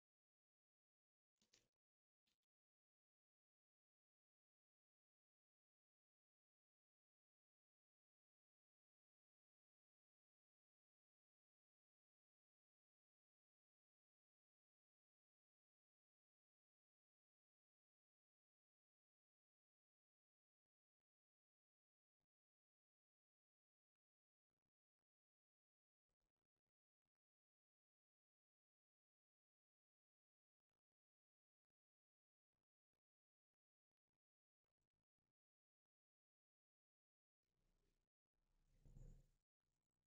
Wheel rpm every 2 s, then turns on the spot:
0, 0, 0, 0, 0, 0, 0, 0, 0, 0, 0, 0, 0, 0, 0, 0, 0, 0, 0, 0.
none